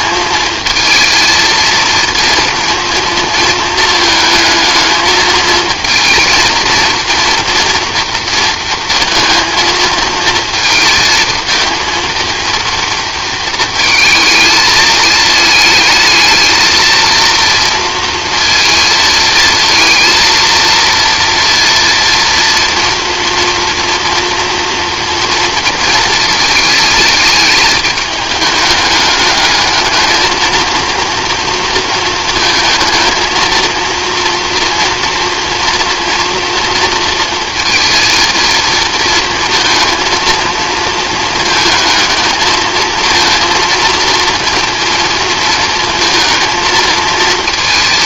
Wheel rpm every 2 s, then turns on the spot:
220, 230, 220, 230, 230, 230, 230, 220, 220, 230, 230, 230, 230, 220, 210, 220, 230, 230, 230, 230, 220, 220, 230, 230.
none